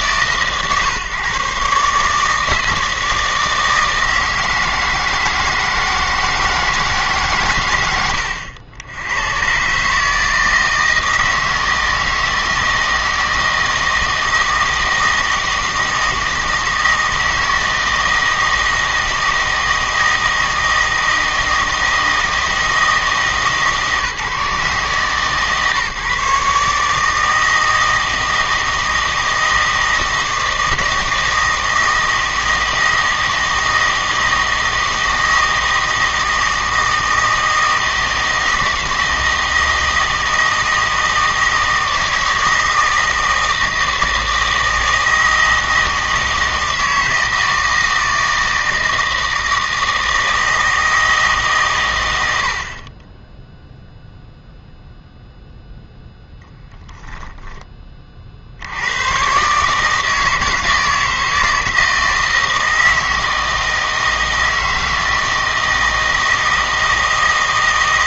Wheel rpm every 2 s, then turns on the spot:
140, 160, 160, 160, 80, 160, 160, 160, 160, 160, 160, 160, 140, 150, 160, 160, 160, 160, 160, 160, 160, 160, 160, 160, 160, 160, 60, 0, 0, 80, 160, 160, 160, 160.
none